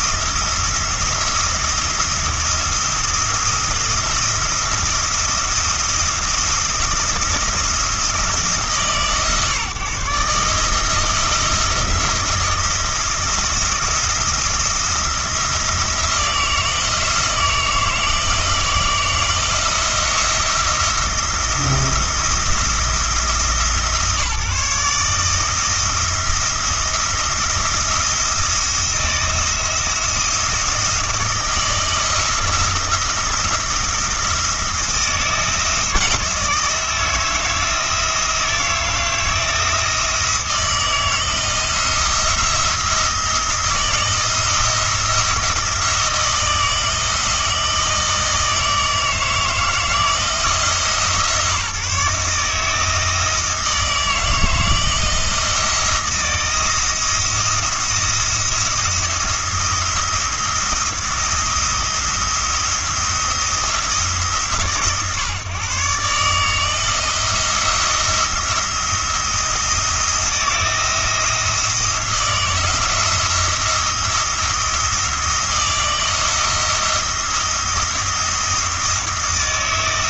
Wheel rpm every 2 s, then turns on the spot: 170, 170, 170, 170, 150, 160, 170, 170, 160, 160, 170, 170, 160, 170, 170, 160, 170, 170, 160, 170, 170, 170, 160, 160, 160, 160, 150, 160, 170, 170, 170, 170, 140, 160, 170, 170, 170, 160, 170, 170.
none